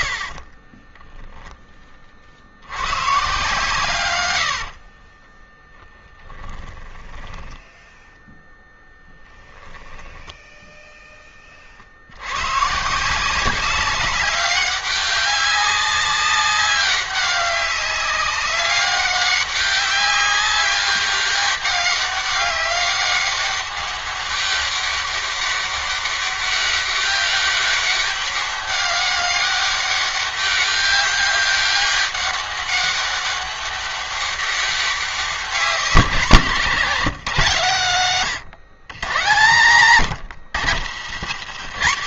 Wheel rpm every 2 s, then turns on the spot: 20, 110, 40, 10, 0, 10, 160, 200, 200, 200, 200, 200, 200, 200, 200, 200, 200, 190, 150, 120, 140.
0-2 4-8